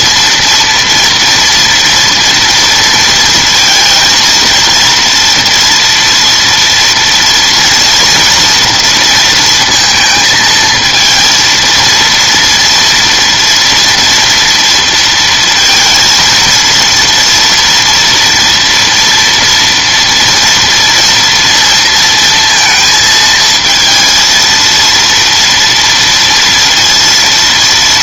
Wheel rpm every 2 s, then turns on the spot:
230, 230, 230, 240, 240, 230, 230, 230, 230, 230, 230, 230, 230, 230.
none